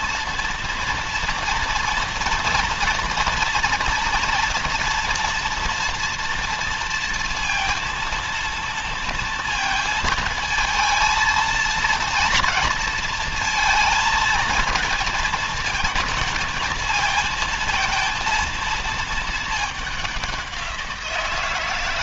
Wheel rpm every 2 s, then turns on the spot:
230, 230, 230, 230, 230, 230, 230, 220, 220, 220, 180.
none